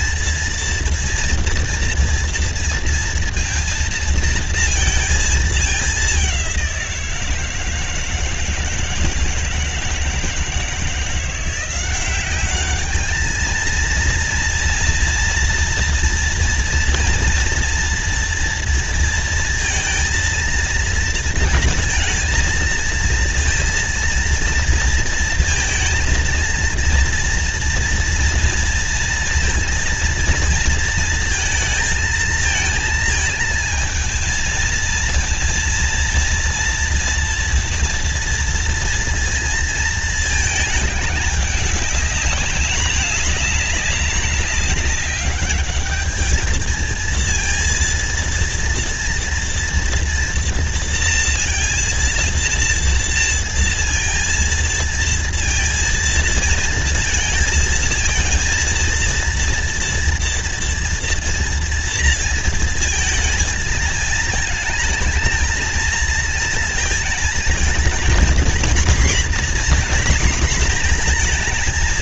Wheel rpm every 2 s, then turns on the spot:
230, 230, 230, 180, 160, 160, 200, 230, 230, 230, 230, 230, 230, 230, 230, 230, 220, 220, 230, 230, 220, 200, 200, 220, 230, 230, 230, 230, 230, 230, 230, 230, 220, 230, 240, 240.
none